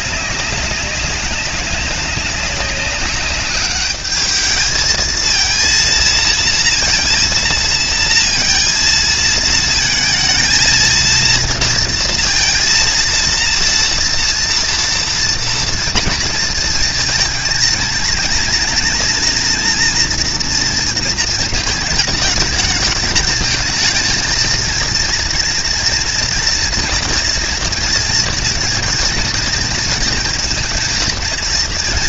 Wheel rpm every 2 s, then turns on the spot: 190, 200, 220, 230, 220, 230, 230, 230, 230, 230, 230, 210, 230, 230, 230, 230.
none